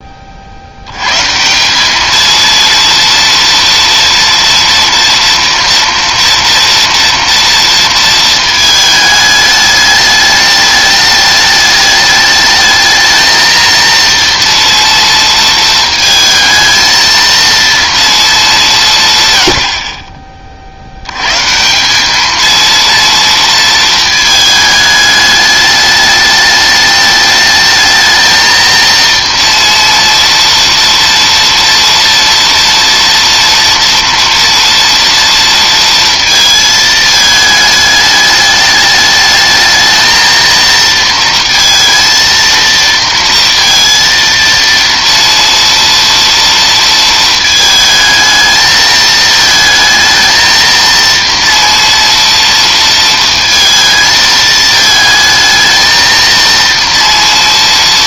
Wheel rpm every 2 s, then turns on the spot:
70, 230, 230, 230, 220, 210, 220, 230, 220, 200, 50, 220, 220, 210, 230, 230, 230, 230, 220, 210, 230, 230, 230, 230, 220, 230, 230, 220, 230.
none